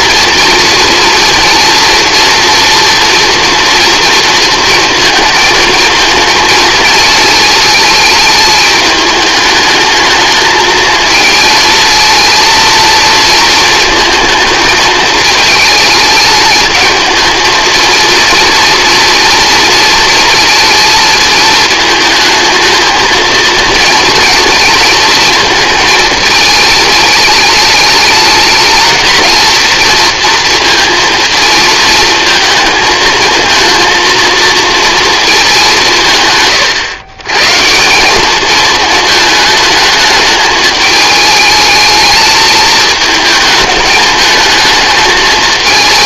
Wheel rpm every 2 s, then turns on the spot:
230, 230, 220, 220, 210, 230, 230, 210, 220, 230, 220, 230, 220, 210, 230, 220, 230, 180, 160, 220, 220, 220, 220.
none